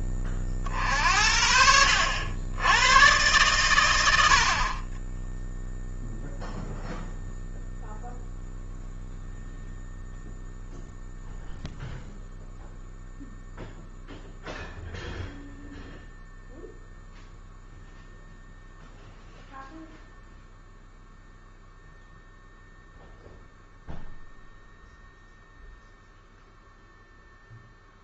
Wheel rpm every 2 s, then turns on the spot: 40, 100, 40, 0, 0, 0, 0, 0, 0, 0, 0, 0, 0, 0.
none